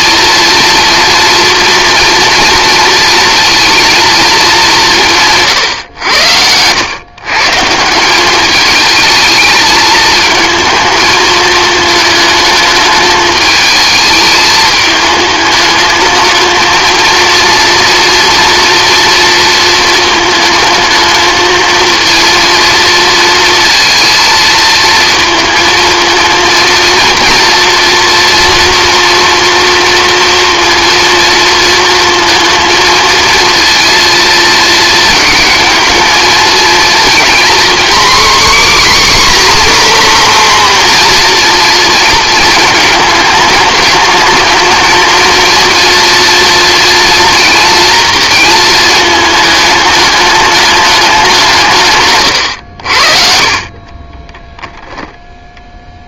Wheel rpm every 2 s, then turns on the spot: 230, 230, 180, 110, 220, 220, 210, 210, 230, 230, 220, 230, 220, 230, 230, 230, 230, 230, 230, 280, 250, 210, 220, 230, 220, 200, 60, 0.
none